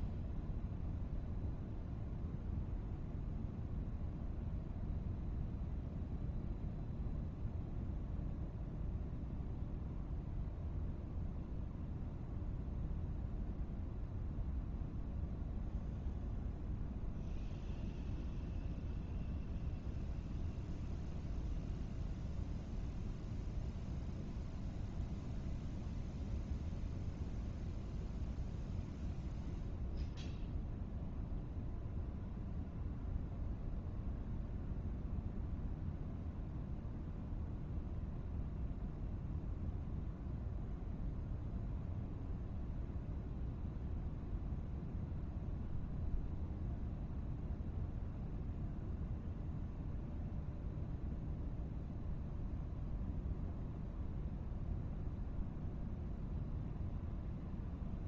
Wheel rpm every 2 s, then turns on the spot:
0, 0, 0, 0, 0, 0, 0, 0, 0, 0, 0, 0, 0, 0, 0, 0, 0, 0, 0, 0, 0, 0, 0, 0, 0, 0, 0, 0, 0.
none